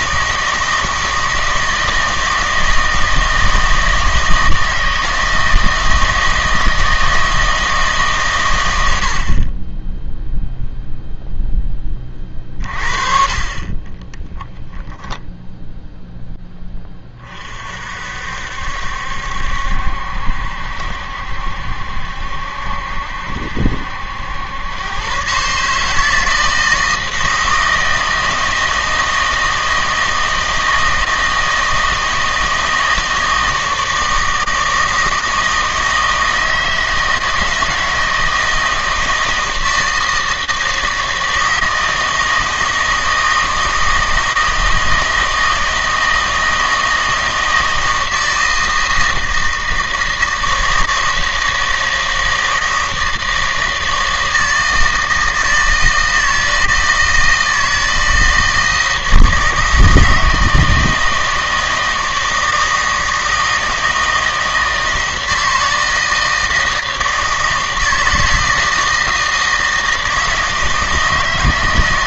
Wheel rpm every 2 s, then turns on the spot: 160, 160, 160, 160, 100, 0, 40, 10, 10, 70, 70, 70, 100, 160, 160, 160, 160, 160, 160, 160, 160, 160, 160, 160, 160, 160, 160, 160, 160, 160, 160, 160, 160, 160, 160, 160.
none